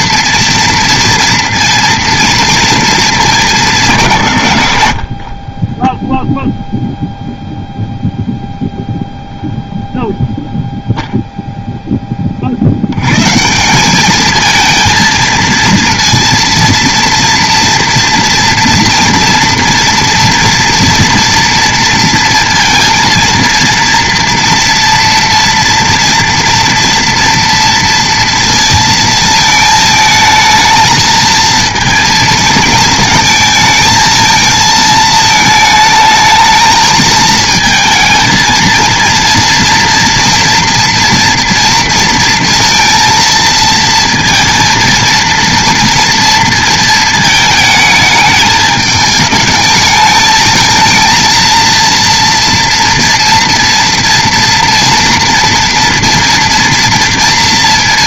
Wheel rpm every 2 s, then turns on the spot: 230, 220, 70, 0, 0, 0, 70, 230, 230, 230, 230, 230, 230, 230, 230, 220, 220, 220, 220, 230, 240, 230, 230, 230, 210, 220, 230, 230, 240.
none